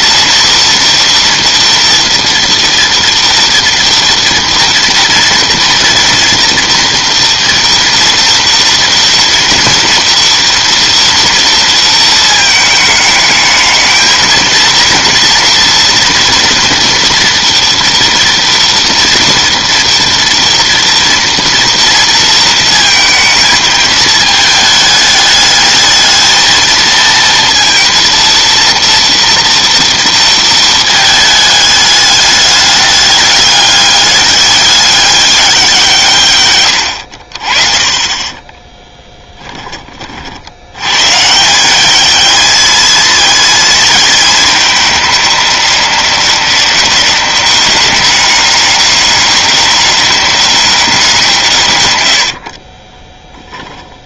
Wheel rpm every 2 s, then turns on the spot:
230, 230, 230, 230, 230, 230, 220, 230, 230, 240, 230, 230, 210, 230, 230, 220, 210, 200, 90, 10, 80, 220, 210, 190, 200, 200, 60.
38-40 52-54